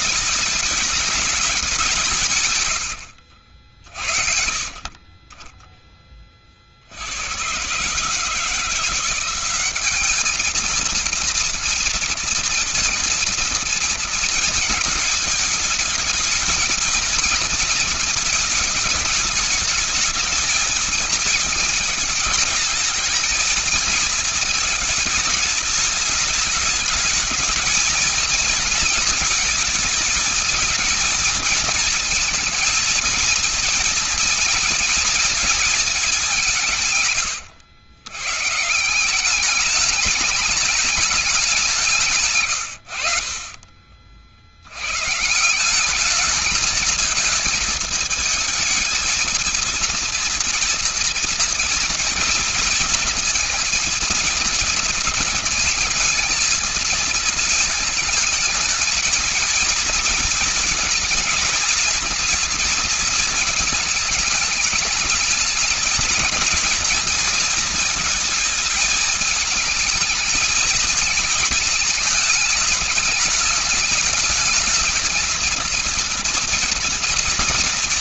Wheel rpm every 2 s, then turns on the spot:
210, 80, 40, 70, 170, 230, 230, 220, 230, 220, 220, 220, 210, 210, 230, 220, 220, 230, 160, 160, 210, 100, 100, 220, 220, 230, 230, 230, 230, 220, 230, 230, 210, 230, 220, 220, 220, 220, 230.
2-4